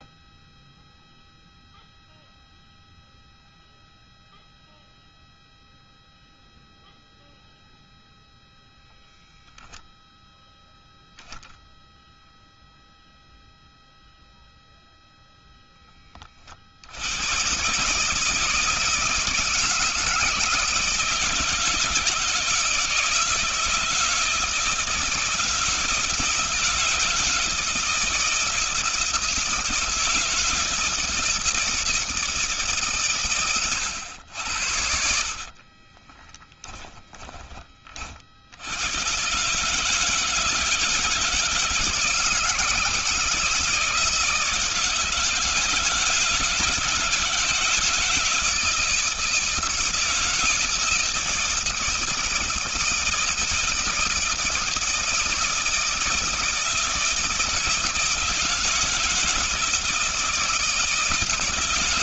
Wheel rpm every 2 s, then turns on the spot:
0, 0, 0, 0, 0, 0, 0, 0, 50, 160, 160, 160, 160, 160, 160, 160, 160, 90, 10, 80, 160, 160, 160, 160, 160, 160, 160, 160, 160, 170, 160.
36-38